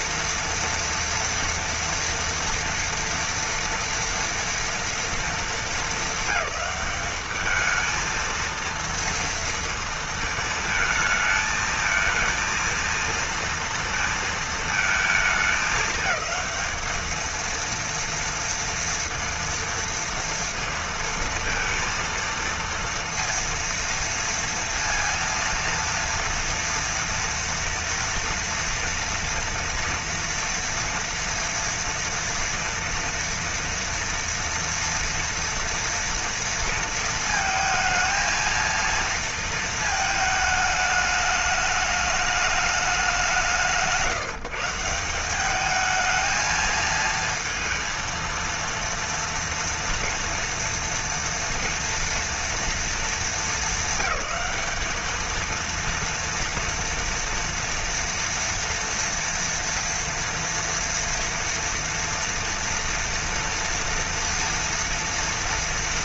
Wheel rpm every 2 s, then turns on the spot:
230, 230, 230, 210, 230, 220, 230, 230, 220, 230, 230, 230, 230, 230, 230, 230, 230, 230, 230, 230, 220, 210, 150, 220, 230, 230, 230, 200, 240, 230, 230, 230, 230.
none